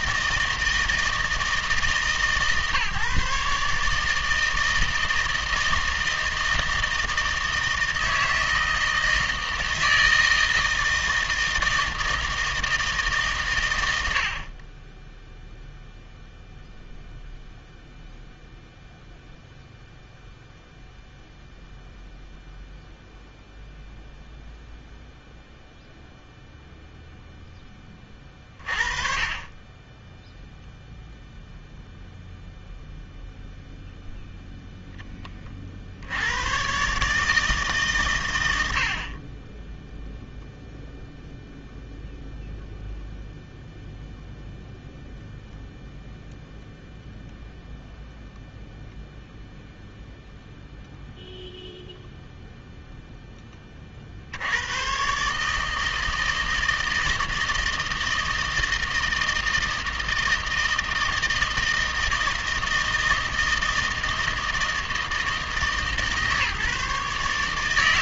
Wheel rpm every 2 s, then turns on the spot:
160, 150, 160, 160, 160, 160, 160, 10, 0, 0, 0, 0, 0, 0, 30, 0, 0, 0, 130, 70, 0, 0, 0, 0, 0, 0, 0, 120, 160, 160, 160, 160, 160, 150.
none